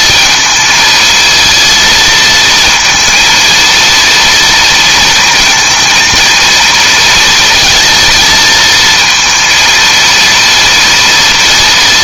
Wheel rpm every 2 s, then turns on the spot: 220, 230, 230, 230, 220, 230.
none